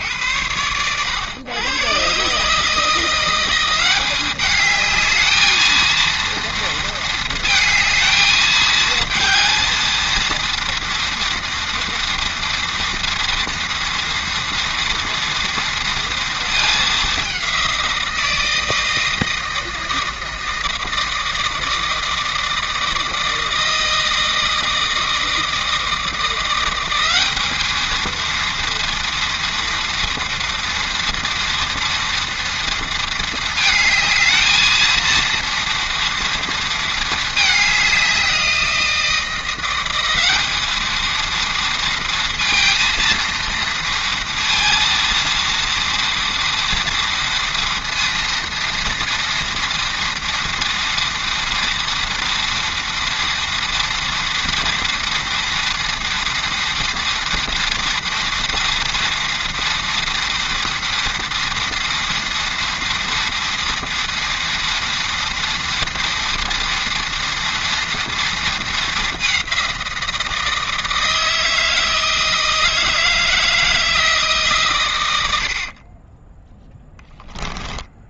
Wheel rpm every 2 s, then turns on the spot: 100, 160, 210, 230, 220, 230, 230, 230, 210, 160, 160, 160, 160, 190, 230, 230, 230, 220, 220, 170, 220, 230, 230, 230, 230, 230, 230, 230, 230, 230, 230, 230, 230, 240, 210, 160, 160, 110, 0.
none